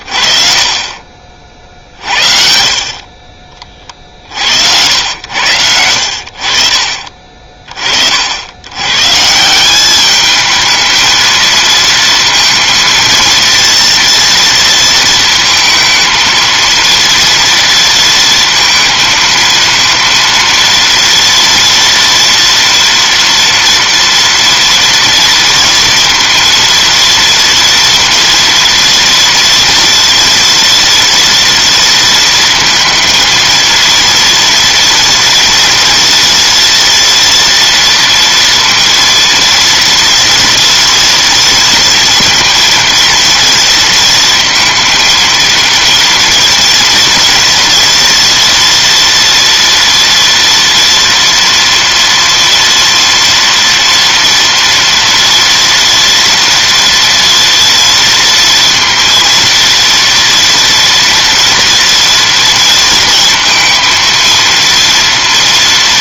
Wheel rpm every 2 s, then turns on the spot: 40, 50, 80, 50, 120, 220, 230, 230, 230, 230, 230, 230, 230, 230, 230, 240, 230, 230, 240, 230, 230, 230, 230, 230, 240, 230, 230, 230, 230, 230, 230, 230, 230.
0-2